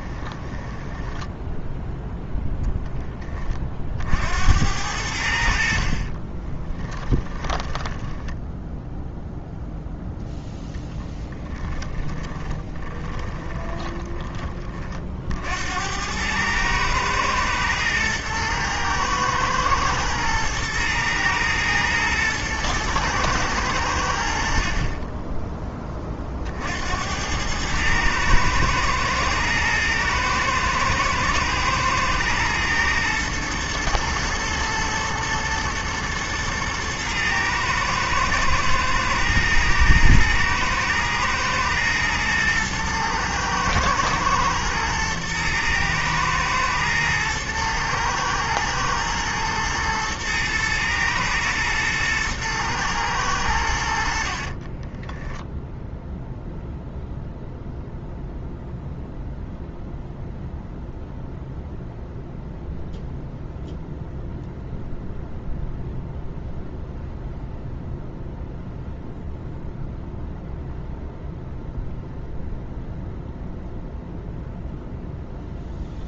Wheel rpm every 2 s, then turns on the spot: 10, 0, 80, 10, 0, 10, 20, 50, 110, 110, 120, 120, 30, 70, 110, 120, 110, 110, 110, 120, 110, 110, 110, 110, 110, 110, 110, 20, 0, 0, 0, 0, 0, 0, 0, 0, 0, 0.
0-2 6-8 12-14 54-56